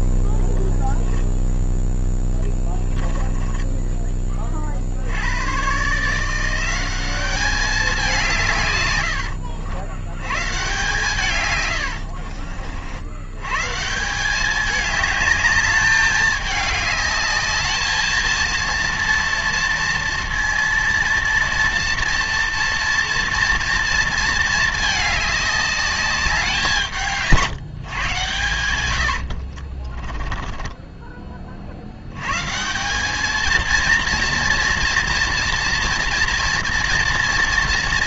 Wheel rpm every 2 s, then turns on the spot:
0, 10, 50, 180, 140, 140, 60, 210, 210, 230, 230, 230, 220, 180, 90, 20, 150, 230, 230.
2-4 30-32